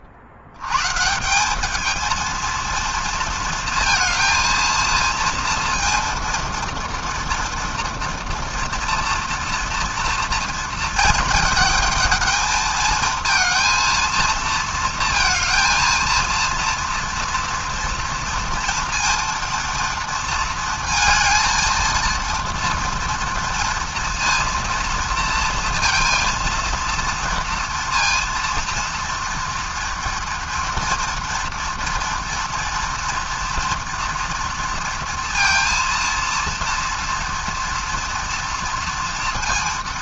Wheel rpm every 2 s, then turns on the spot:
100, 230, 230, 240, 230, 230, 220, 220, 230, 230, 230, 230, 230, 230, 230, 230, 230, 230, 230, 230.
none